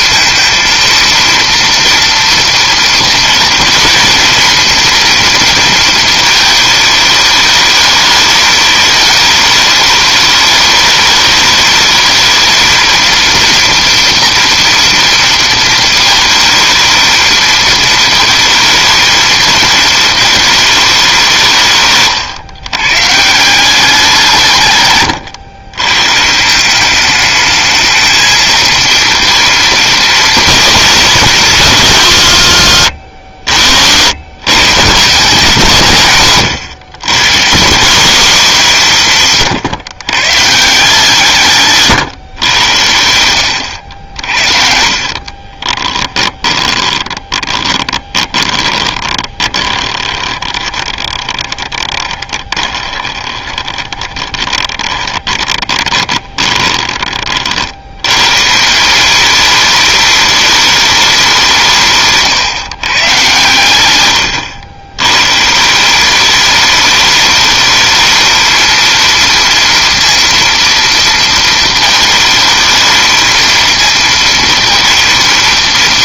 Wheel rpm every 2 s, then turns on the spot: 230, 230, 240, 220, 210, 210, 220, 240, 220, 220, 210, 130, 140, 180, 220, 230, 140, 140, 130, 200, 150, 110, 60, 20, 30, 20, 20, 20, 20, 150, 210, 130, 90, 210, 220, 230, 220, 230.
44-58